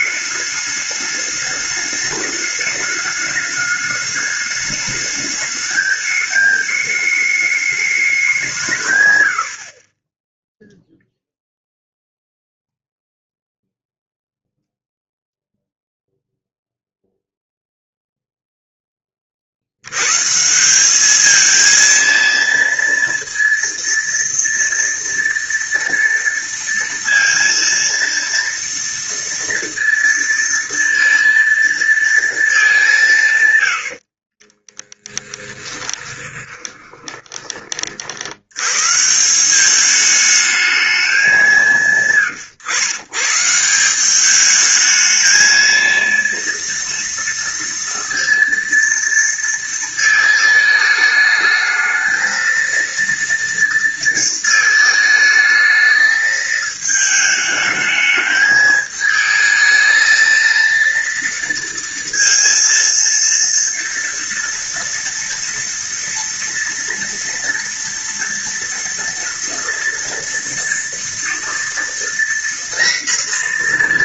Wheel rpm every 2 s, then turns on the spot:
210, 210, 210, 210, 130, 0, 0, 0, 0, 10, 200, 230, 230, 230, 230, 230, 180, 10, 20, 130, 210, 120, 220, 230, 230, 220, 230, 220, 220, 220, 230, 230, 230, 230, 230, 240, 240.
34-38